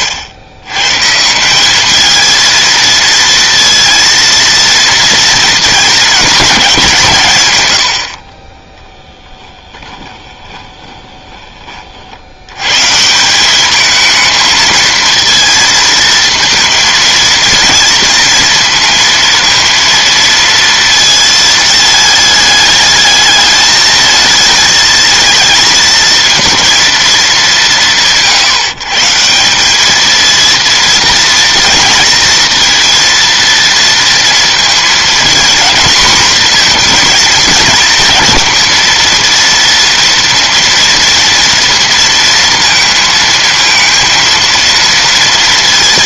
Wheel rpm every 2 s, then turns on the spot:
120, 230, 230, 190, 10, 30, 130, 220, 230, 230, 230, 210, 220, 230, 140, 230, 230, 230, 240, 230, 230, 230, 230.
10-12